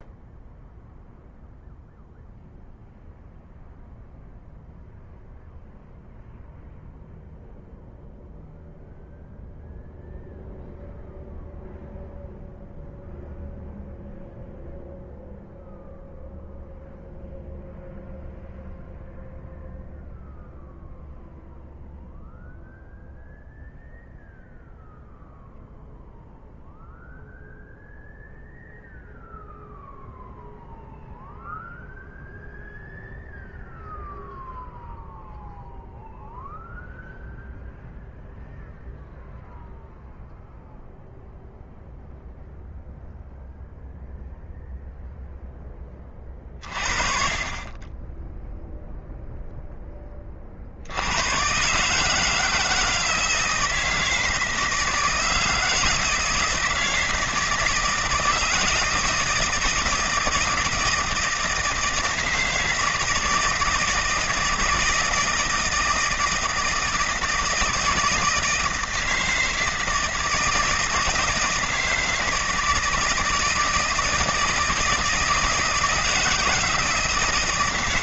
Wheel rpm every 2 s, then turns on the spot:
0, 0, 0, 0, 0, 0, 0, 0, 0, 0, 0, 0, 0, 0, 0, 0, 0, 0, 0, 0, 0, 0, 0, 30, 0, 80, 160, 160, 160, 160, 160, 160, 160, 160, 160, 160, 160, 170, 160.
none